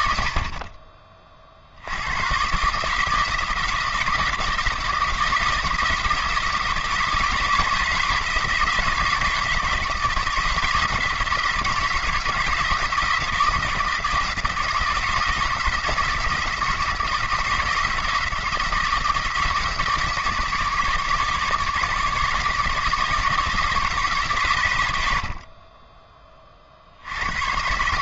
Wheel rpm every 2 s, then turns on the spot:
40, 150, 170, 160, 160, 170, 170, 160, 170, 160, 150, 160, 90, 50.
none